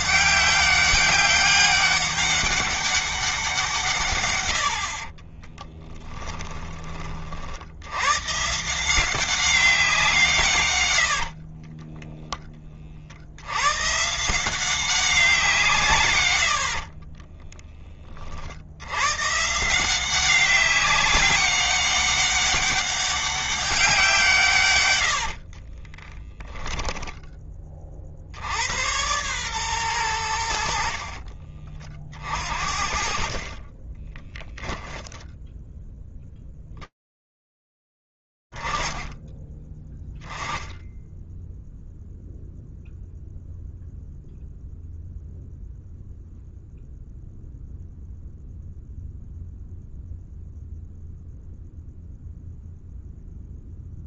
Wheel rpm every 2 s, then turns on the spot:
200, 200, 80, 30, 150, 130, 20, 180, 70, 70, 190, 200, 120, 10, 90, 80, 50, 10, 10, 10, 0, 0, 0, 0, 0, 0, 0.
16-18 26-28